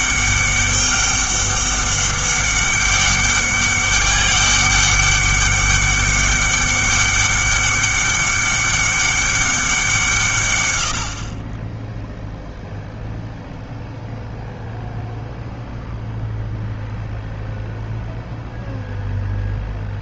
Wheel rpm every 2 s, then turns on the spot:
200, 200, 200, 200, 200, 100, 0, 0, 0, 0.
none